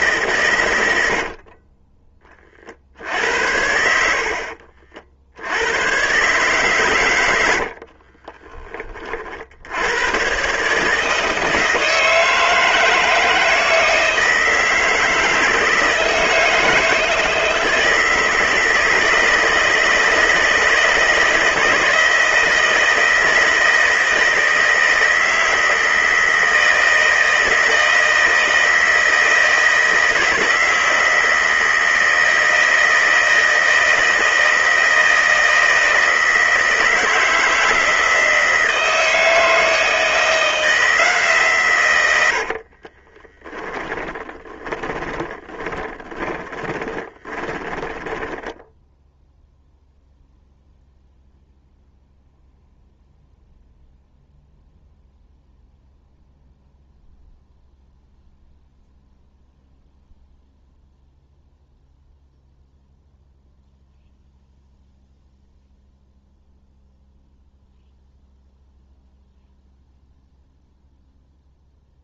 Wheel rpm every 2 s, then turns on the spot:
90, 40, 50, 130, 30, 150, 160, 160, 160, 160, 160, 160, 160, 160, 160, 160, 160, 160, 160, 160, 160, 40, 30, 20, 0, 0, 0, 0, 0, 0, 0, 0, 0, 0, 0, 0.
0-2 42-48